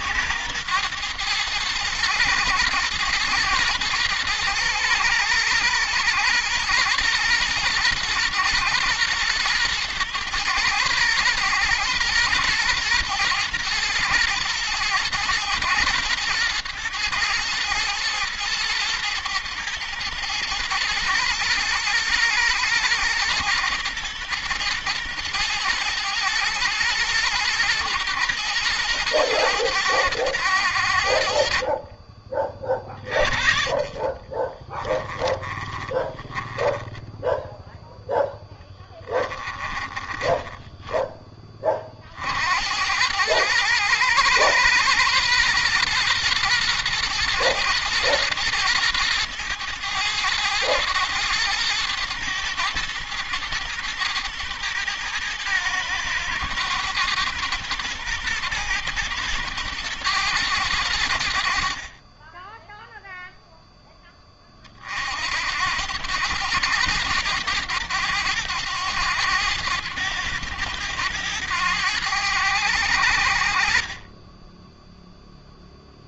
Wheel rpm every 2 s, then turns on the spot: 110, 110, 110, 110, 120, 110, 120, 110, 110, 110, 110, 110, 120, 110, 120, 80, 30, 20, 10, 10, 20, 90, 110, 120, 110, 110, 110, 110, 110, 110, 90, 0, 50, 110, 100, 100, 80, 0.
34-42